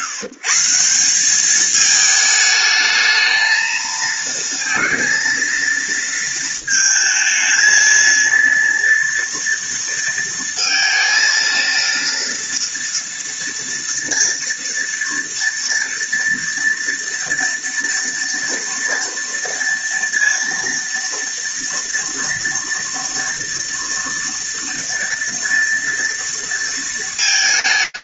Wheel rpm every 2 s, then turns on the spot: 160, 220, 230, 220, 230, 230, 230, 230, 230, 230, 230, 230, 230, 220.
none